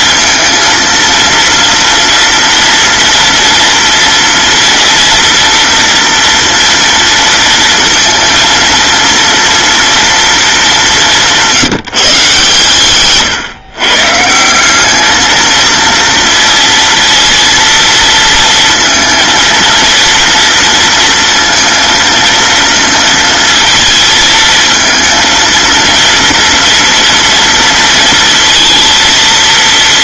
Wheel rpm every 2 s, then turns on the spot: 230, 230, 240, 230, 230, 210, 130, 190, 230, 220, 230, 230, 220, 230, 230.
none